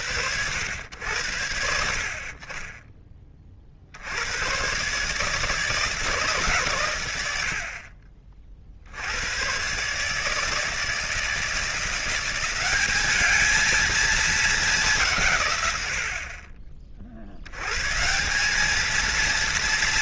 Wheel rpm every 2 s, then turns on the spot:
90, 20, 120, 130, 60, 160, 190, 200, 40, 200.
none